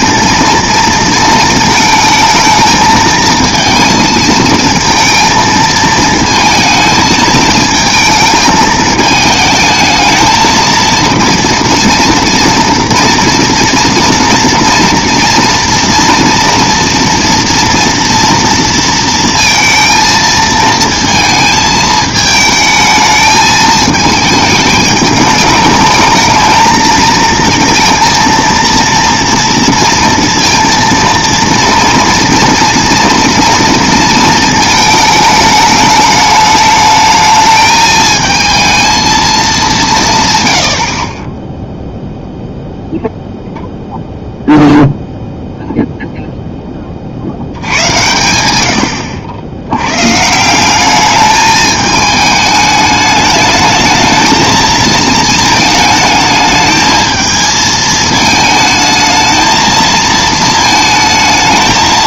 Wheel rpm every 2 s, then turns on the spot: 230, 220, 220, 220, 220, 220, 230, 230, 240, 230, 230, 220, 220, 220, 230, 230, 230, 220, 210, 220, 90, 0, 0, 10, 90, 180, 210, 220, 220, 220, 220.
none